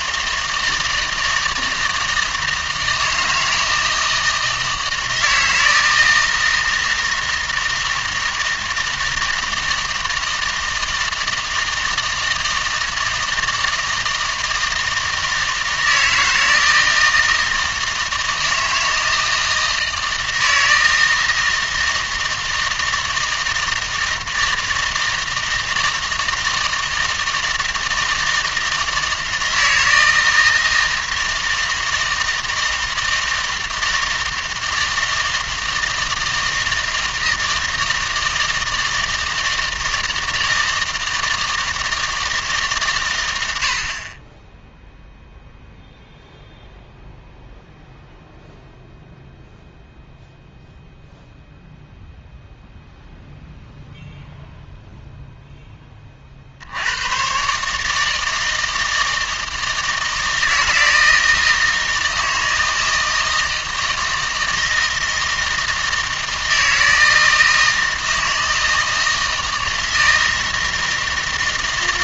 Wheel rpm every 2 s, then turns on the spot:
160, 160, 160, 160, 160, 160, 160, 160, 160, 160, 160, 160, 160, 160, 160, 160, 160, 160, 160, 160, 160, 150, 10, 0, 0, 0, 0, 0, 70, 160, 160, 160, 160, 160, 160, 160.
none